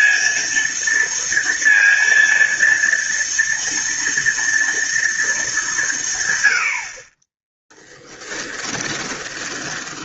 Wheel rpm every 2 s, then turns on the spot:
230, 230, 230, 90, 20.
8-10